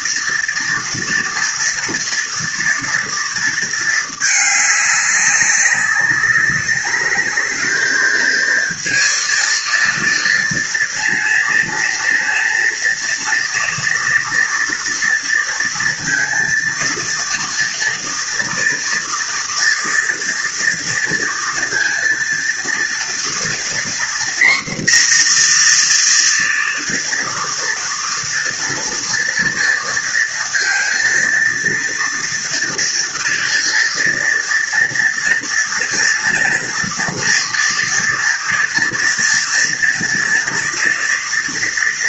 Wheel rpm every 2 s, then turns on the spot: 230, 230, 210, 210, 230, 230, 230, 230, 230, 230, 230, 230, 240, 230, 230, 230, 230, 230, 230, 230, 230.
none